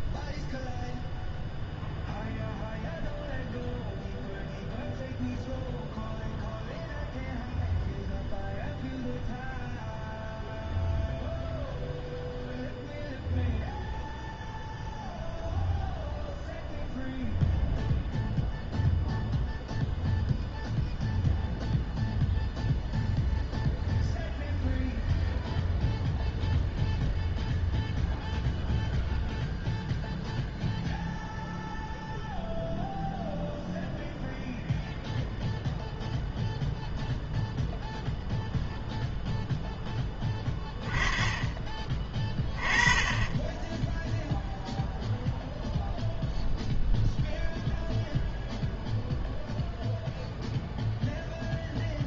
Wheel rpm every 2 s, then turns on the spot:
0, 0, 0, 0, 0, 0, 0, 0, 0, 0, 0, 0, 0, 0, 0, 0, 0, 0, 0, 0, 20, 20, 0, 0, 0, 0.
none